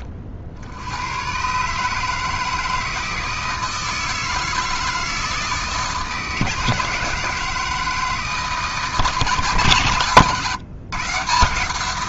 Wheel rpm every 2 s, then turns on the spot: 80, 160, 160, 160, 160, 150.
none